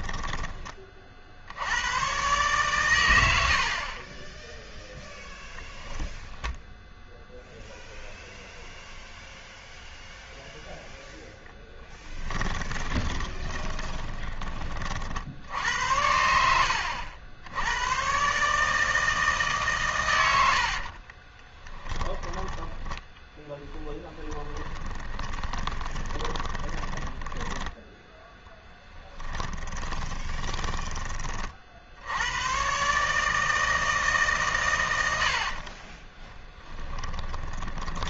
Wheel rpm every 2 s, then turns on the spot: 30, 120, 0, 0, 0, 0, 20, 30, 70, 150, 50, 10, 20, 20, 10, 20, 130, 120, 10.
12-14 20-32 36-38